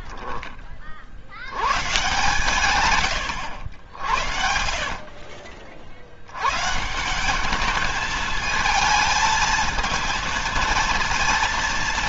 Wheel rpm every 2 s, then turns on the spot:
30, 130, 50, 150, 220, 230.
4-6